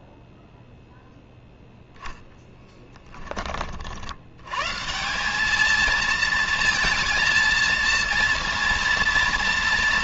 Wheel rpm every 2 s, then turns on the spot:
0, 10, 180, 220, 230.
none